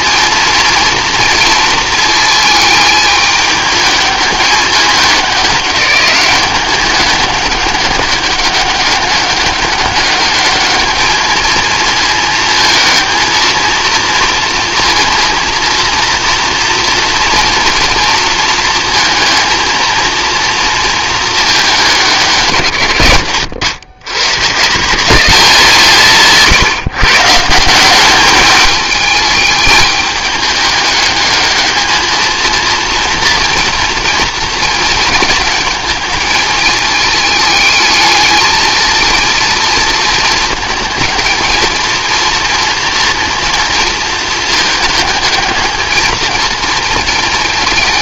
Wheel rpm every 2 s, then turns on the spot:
230, 220, 210, 200, 200, 210, 220, 230, 240, 230, 230, 140, 150, 160, 210, 210, 230, 220, 210, 220, 220, 230, 220, 230.
none